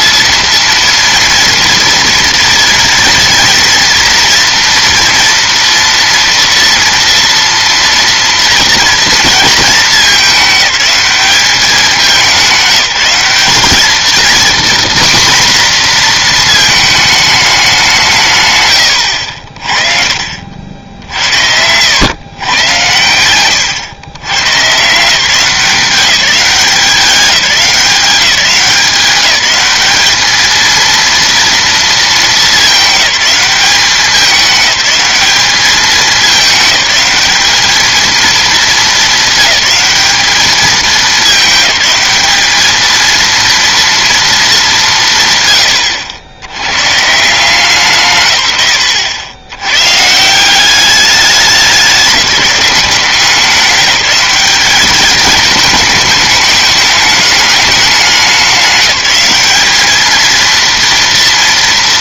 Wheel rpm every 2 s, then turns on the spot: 230, 230, 230, 230, 230, 200, 190, 240, 220, 100, 70, 120, 150, 190, 180, 230, 210, 210, 210, 220, 200, 220, 170, 120, 120, 200, 190, 210, 210, 190, 230.
18-20